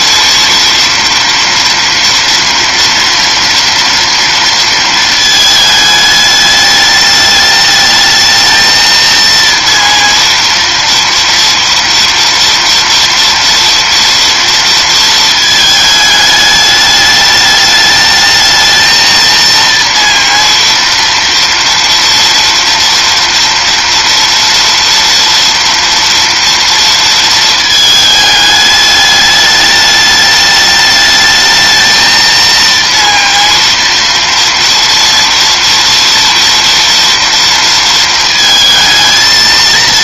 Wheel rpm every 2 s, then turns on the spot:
230, 230, 230, 210, 230, 230, 230, 230, 210, 220, 230, 230, 230, 230, 210, 210, 230, 230, 230, 220.
none